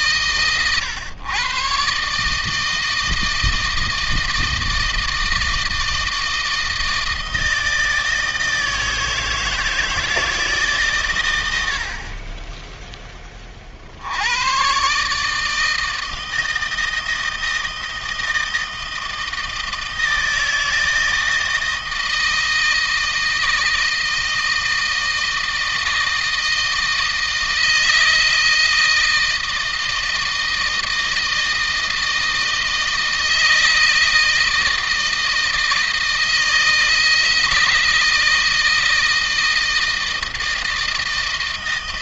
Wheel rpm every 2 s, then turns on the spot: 110, 160, 160, 160, 160, 140, 10, 140, 160, 160, 160, 160, 160, 160, 160, 160, 160, 160, 160, 160, 160.
none